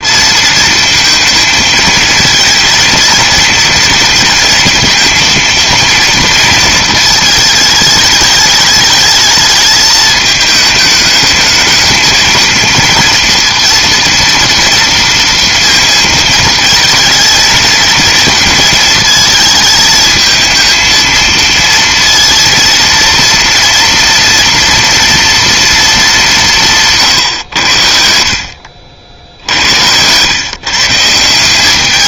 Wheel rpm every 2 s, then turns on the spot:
230, 220, 230, 230, 210, 210, 230, 230, 230, 230, 220, 230, 240, 160, 70, 140.
none